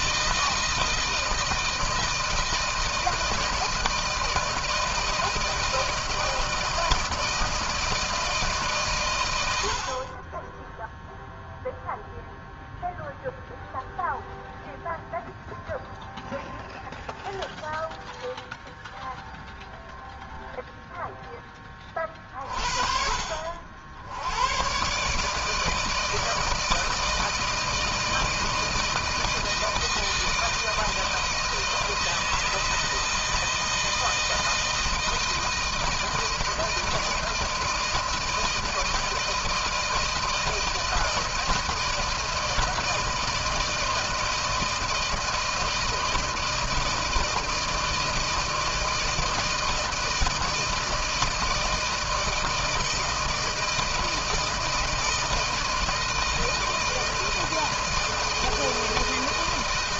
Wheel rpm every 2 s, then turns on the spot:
160, 160, 160, 160, 140, 10, 0, 0, 0, 0, 0, 40, 120, 160, 160, 160, 160, 160, 160, 160, 160, 160, 160, 160, 160, 160, 160, 160, 160, 160.
none